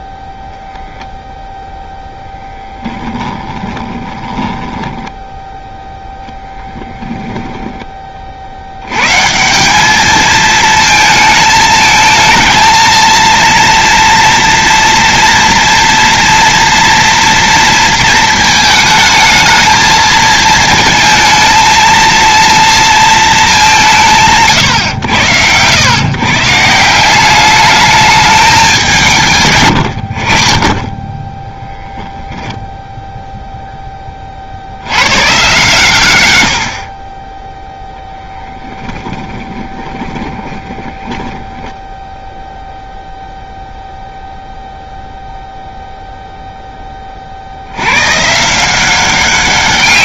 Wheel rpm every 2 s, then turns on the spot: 0, 10, 10, 10, 70, 220, 230, 240, 230, 220, 220, 230, 100, 150, 200, 20, 0, 100, 60, 20, 20, 0, 0, 10, 170.
2-8 38-42